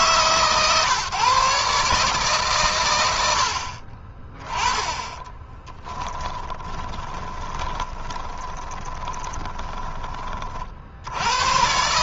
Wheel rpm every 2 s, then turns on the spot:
150, 120, 20, 10, 20, 60.
6-10